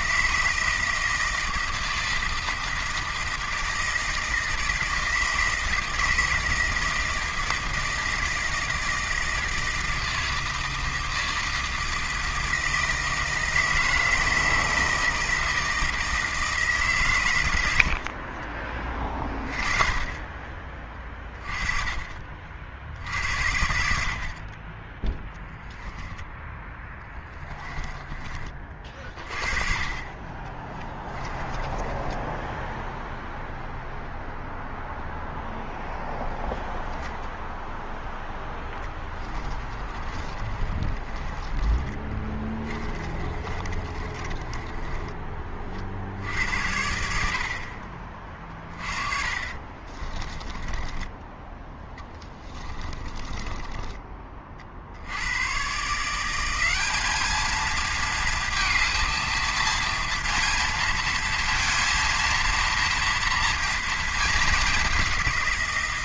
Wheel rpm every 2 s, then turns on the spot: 160, 160, 160, 160, 160, 160, 160, 160, 150, 30, 30, 50, 20, 10, 30, 20, 10, 0, 0, 10, 30, 20, 20, 80, 40, 20, 20, 50, 200, 230, 230, 230, 200.
30-34 38-46 50-54